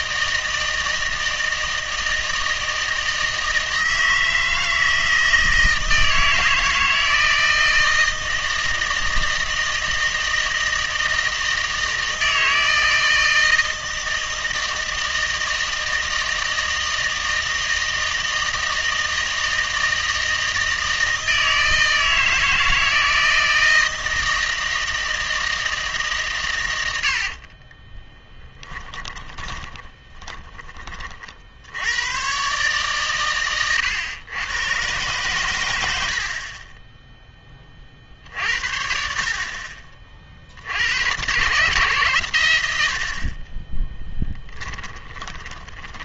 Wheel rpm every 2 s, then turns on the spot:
160, 160, 160, 160, 160, 160, 160, 160, 160, 160, 160, 160, 160, 100, 10, 20, 140, 120, 20, 50, 80, 80, 20.
28-30 44-46